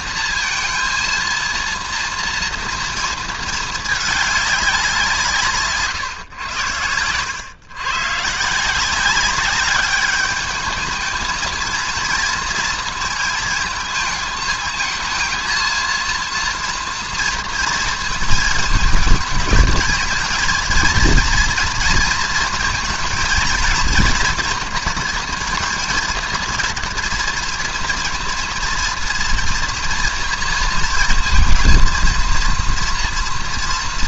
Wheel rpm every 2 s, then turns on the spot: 230, 230, 200, 100, 160, 210, 230, 220, 230, 210, 230, 220, 230, 230, 230, 230, 230.
none